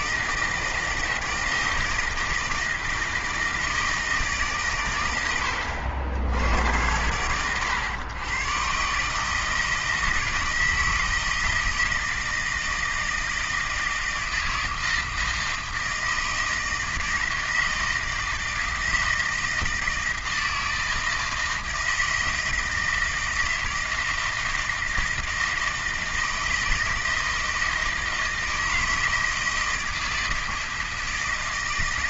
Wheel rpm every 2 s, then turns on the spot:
160, 160, 140, 90, 130, 160, 160, 160, 160, 160, 160, 160, 160, 160, 160, 160.
none